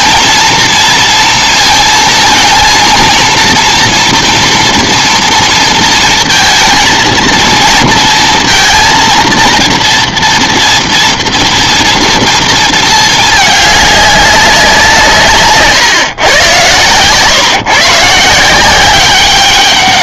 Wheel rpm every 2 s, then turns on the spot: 230, 230, 230, 230, 230, 230, 220, 180, 120, 180.
none